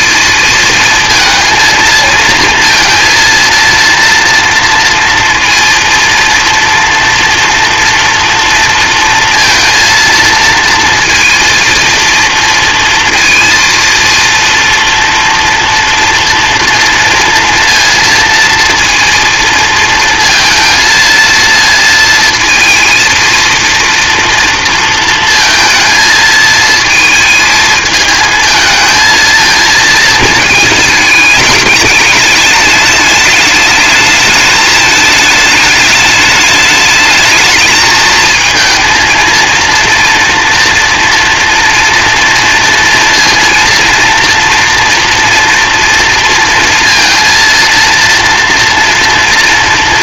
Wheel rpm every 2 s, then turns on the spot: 230, 230, 230, 230, 230, 230, 230, 230, 230, 230, 230, 230, 230, 230, 220, 220, 210, 210, 210, 220, 230, 230, 230, 230, 230.
none